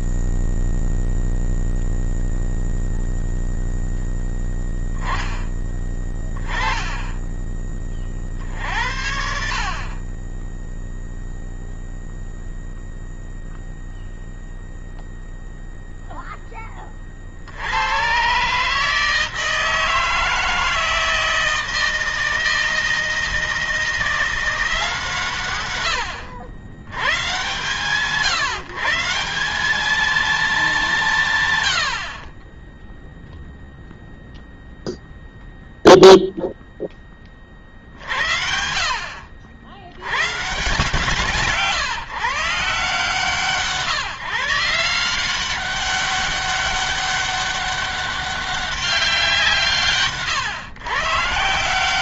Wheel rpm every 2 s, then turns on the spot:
0, 0, 0, 10, 30, 50, 0, 0, 0, 110, 160, 160, 160, 120, 150, 210, 60, 0, 0, 80, 140, 150, 160, 200, 200, 140.
none